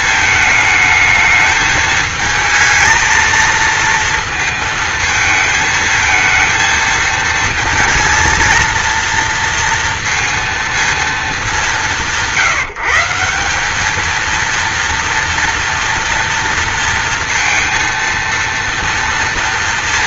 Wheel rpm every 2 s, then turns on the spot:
220, 220, 220, 220, 230, 220, 170, 230, 230, 230.
none